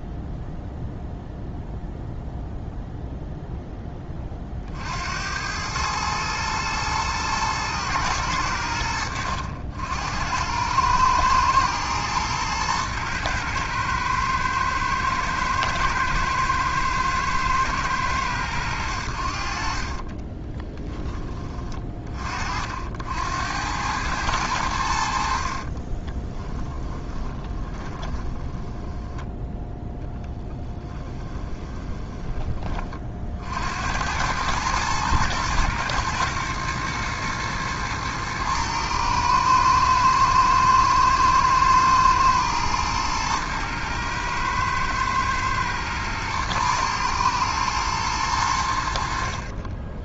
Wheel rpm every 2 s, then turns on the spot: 0, 0, 50, 110, 90, 100, 110, 110, 110, 100, 20, 50, 90, 10, 10, 10, 30, 110, 110, 110, 110, 110, 110, 110, 90.
20-22 26-32